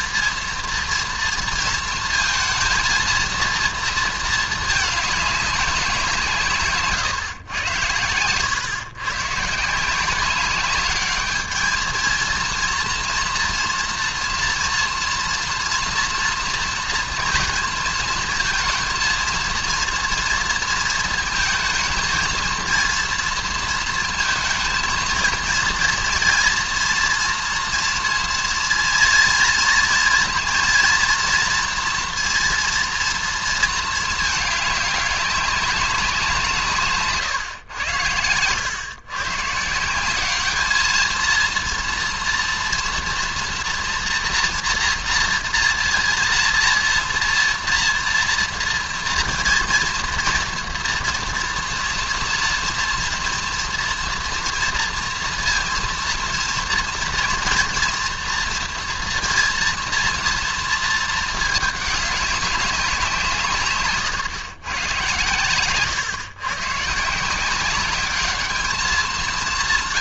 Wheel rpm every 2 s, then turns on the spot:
230, 230, 210, 140, 120, 200, 230, 230, 230, 220, 230, 230, 220, 230, 230, 230, 230, 200, 150, 120, 220, 240, 230, 230, 240, 230, 240, 230, 230, 230, 220, 190, 120, 140, 210.
6-8